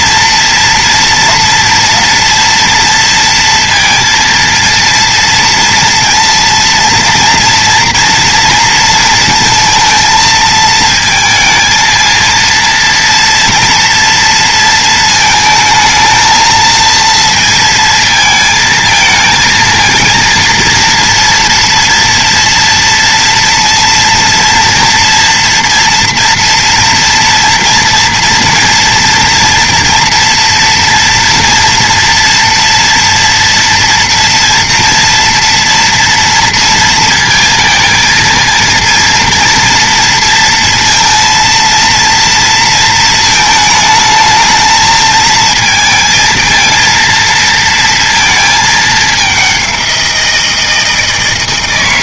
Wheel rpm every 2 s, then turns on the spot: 230, 230, 230, 230, 230, 230, 230, 230, 220, 220, 230, 230, 230, 240, 230, 230, 230, 230, 230, 230, 230, 230, 220, 230, 220, 160.
none